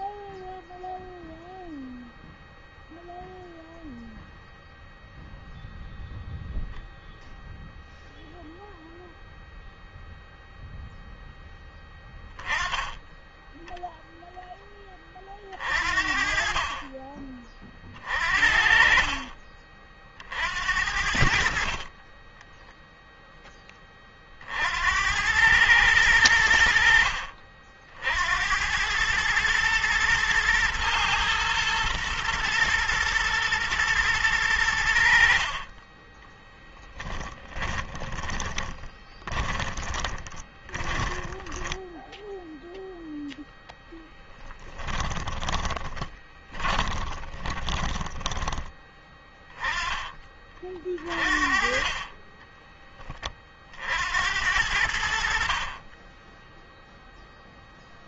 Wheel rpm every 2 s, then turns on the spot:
0, 0, 0, 0, 0, 0, 10, 20, 30, 40, 60, 0, 70, 70, 100, 110, 110, 70, 10, 10, 20, 0, 10, 20, 20, 40, 20, 70, 0.
16-18 36-42 44-48